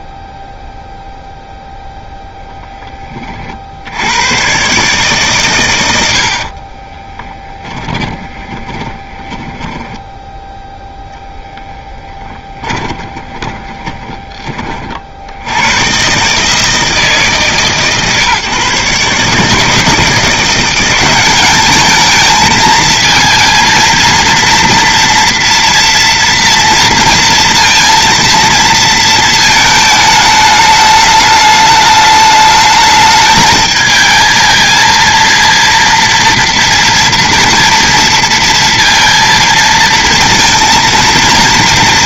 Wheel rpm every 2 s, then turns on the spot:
0, 0, 120, 40, 20, 0, 10, 30, 160, 150, 170, 220, 230, 230, 230, 210, 210, 220, 230, 230, 230.
6-10 12-14